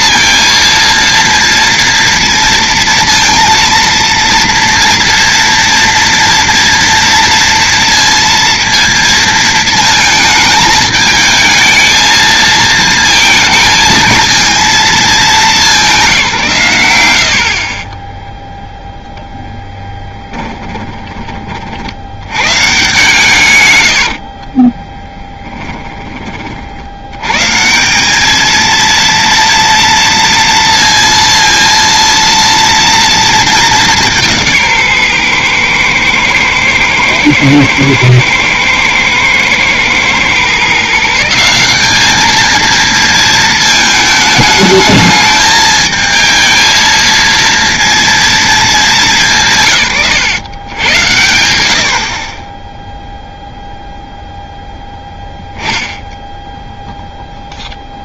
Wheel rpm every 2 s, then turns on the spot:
230, 230, 230, 230, 230, 220, 220, 220, 110, 0, 20, 130, 20, 70, 220, 230, 230, 160, 110, 110, 140, 220, 210, 220, 220, 110, 10, 0, 0.
20-22 24-26